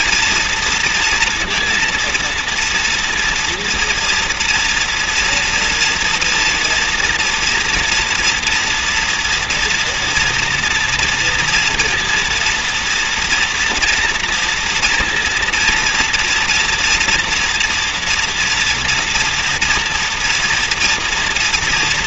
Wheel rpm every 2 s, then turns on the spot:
230, 230, 230, 240, 230, 230, 230, 230, 230, 230, 230.
none